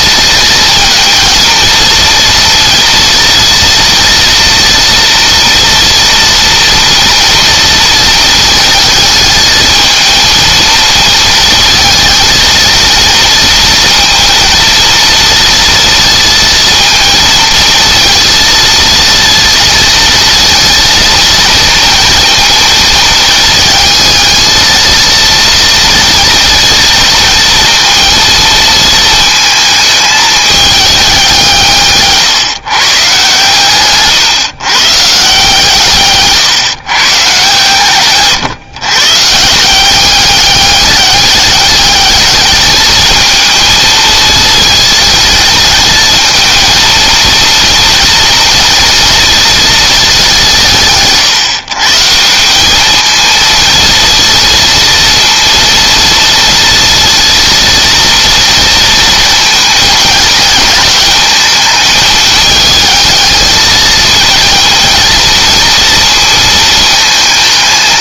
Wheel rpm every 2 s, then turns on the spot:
230, 230, 230, 230, 220, 220, 230, 230, 230, 230, 230, 230, 230, 230, 230, 210, 140, 130, 140, 140, 200, 210, 220, 220, 230, 180, 190, 230, 230, 230, 210, 220, 230, 220.
none